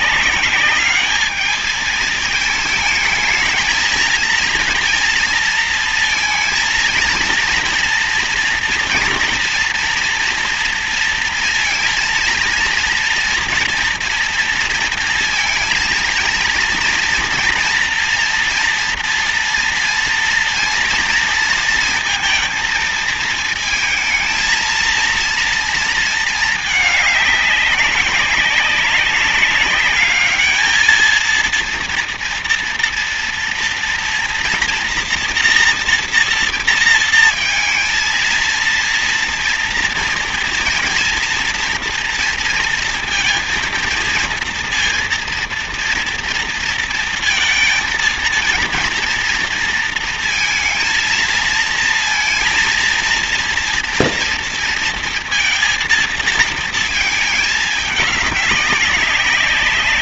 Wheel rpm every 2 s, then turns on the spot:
200, 220, 230, 230, 240, 230, 230, 230, 230, 240, 230, 230, 230, 220, 200, 220, 230, 240, 230, 230, 230, 230, 230, 230, 230, 230, 230, 240, 220, 200.
none